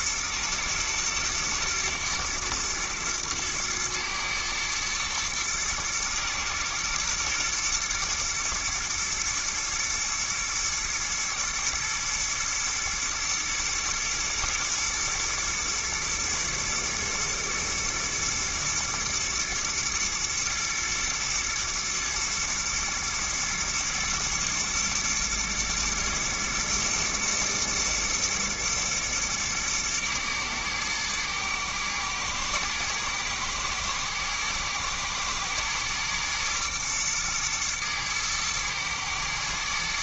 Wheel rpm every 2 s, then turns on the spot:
110, 110, 110, 110, 110, 110, 110, 120, 120, 110, 110, 110, 110, 110, 110, 110, 120, 120, 120, 110.
none